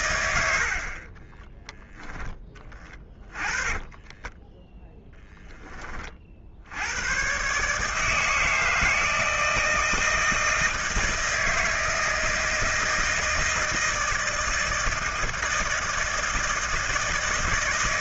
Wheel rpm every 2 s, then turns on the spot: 70, 20, 10, 80, 160, 160, 160, 160, 160.
0-6